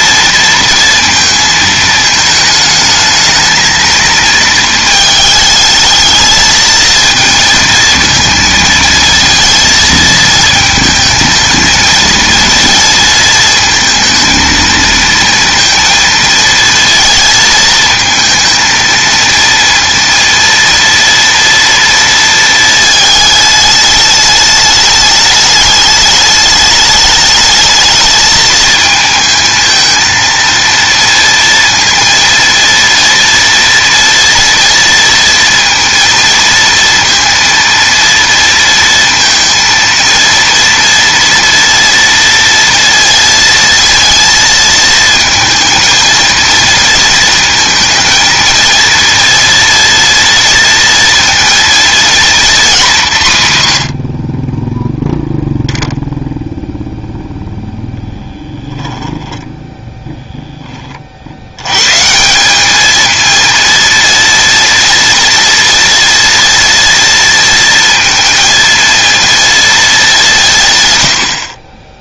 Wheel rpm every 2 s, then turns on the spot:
230, 220, 220, 220, 230, 220, 230, 230, 230, 230, 230, 220, 210, 210, 220, 230, 230, 230, 230, 230, 230, 230, 230, 230, 230, 230, 210, 0, 0, 10, 30, 210, 230, 230, 230, 130.
58-60